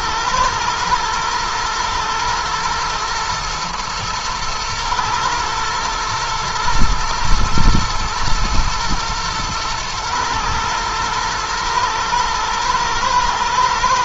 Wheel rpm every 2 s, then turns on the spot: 110, 110, 110, 110, 110, 110, 120.
none